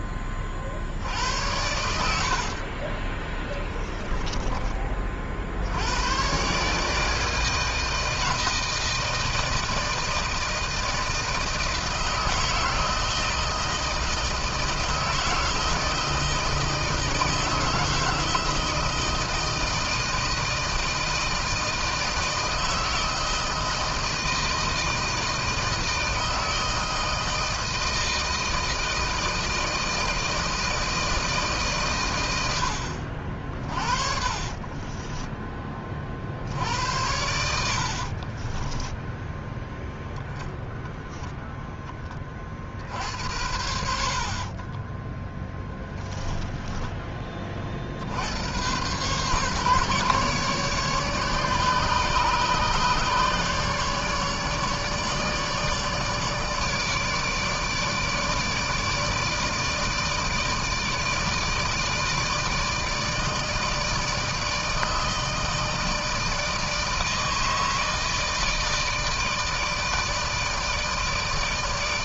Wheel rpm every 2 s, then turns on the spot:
60, 40, 30, 150, 160, 160, 160, 160, 160, 160, 160, 160, 160, 160, 160, 160, 80, 20, 70, 10, 0, 60, 30, 10, 110, 150, 150, 150, 150, 160, 160, 160, 160, 160, 160, 160.
2-4 34-36 38-40 44-46